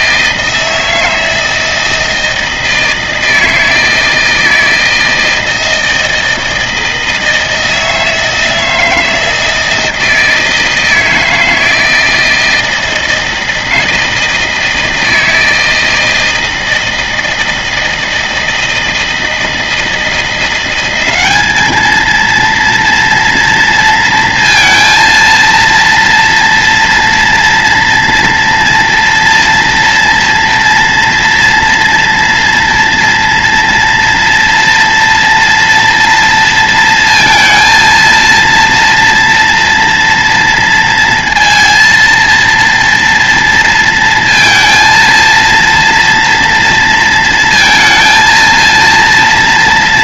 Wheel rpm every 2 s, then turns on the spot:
160, 160, 160, 160, 160, 160, 160, 160, 160, 160, 200, 230, 230, 230, 230, 230, 230, 230, 230, 230, 230, 230, 230, 230, 230.
none